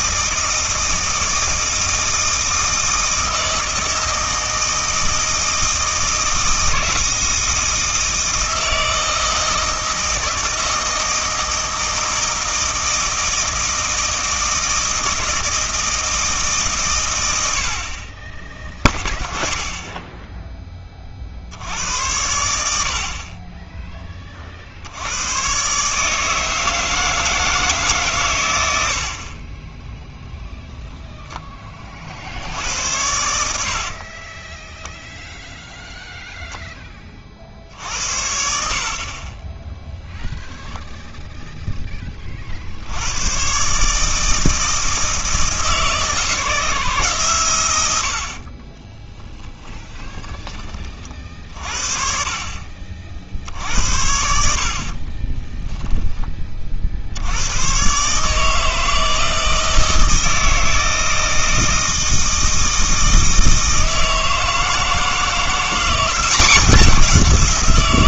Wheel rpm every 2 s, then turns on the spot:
160, 160, 160, 160, 160, 160, 160, 160, 140, 20, 10, 80, 60, 160, 90, 0, 90, 10, 10, 60, 0, 60, 160, 160, 30, 30, 40, 50, 40, 160, 160, 160, 160, 180.
48-50